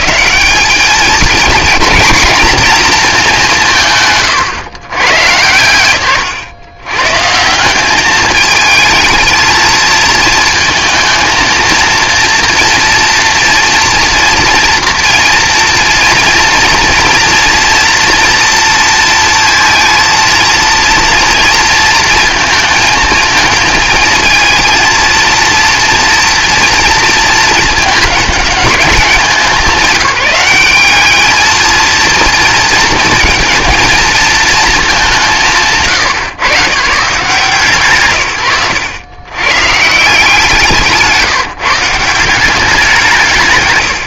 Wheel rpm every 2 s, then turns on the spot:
210, 240, 120, 120, 220, 220, 230, 230, 230, 230, 230, 220, 220, 230, 200, 200, 230, 220, 110, 100, 170, 190.
38-40